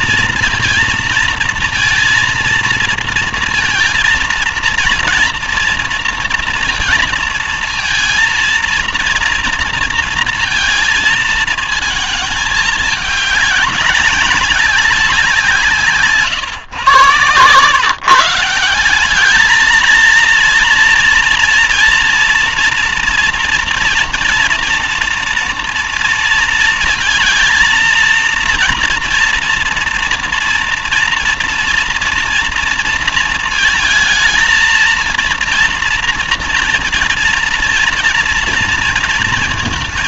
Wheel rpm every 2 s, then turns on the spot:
230, 230, 230, 230, 230, 230, 220, 200, 140, 180, 230, 230, 240, 230, 230, 230, 230, 230, 240, 230.
none